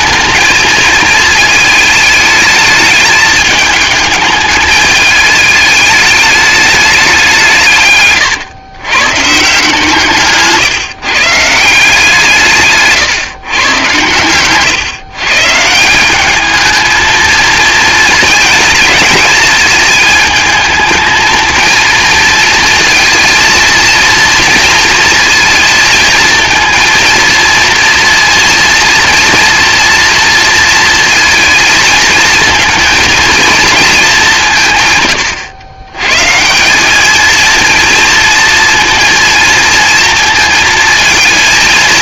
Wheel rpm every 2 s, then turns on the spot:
220, 210, 210, 210, 130, 150, 140, 130, 220, 220, 220, 230, 230, 230, 230, 230, 220, 150, 180, 230, 230.
12-14